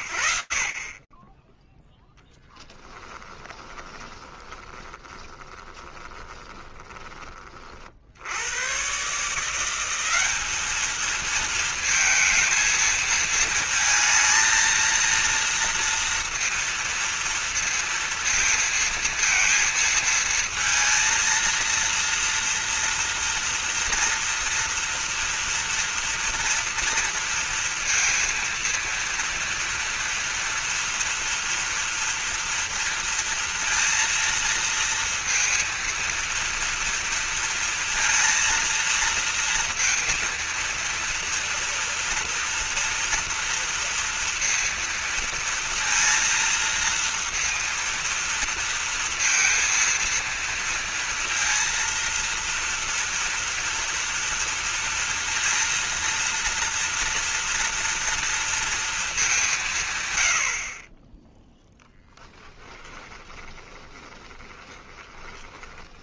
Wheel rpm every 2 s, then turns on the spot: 70, 10, 30, 20, 150, 220, 220, 230, 230, 230, 230, 230, 230, 230, 240, 230, 230, 230, 230, 230, 230, 240, 230, 230, 230, 230, 230, 230, 240, 220, 20, 10, 20.
2-6 62-66